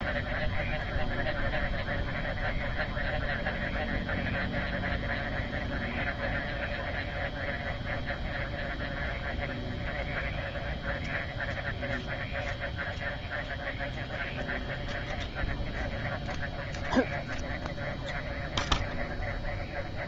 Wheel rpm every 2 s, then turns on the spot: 0, 0, 0, 0, 0, 0, 0, 0, 0, 0.
none